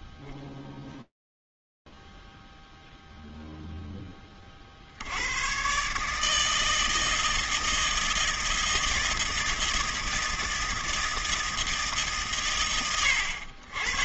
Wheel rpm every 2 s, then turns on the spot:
0, 0, 20, 150, 160, 160, 110.
none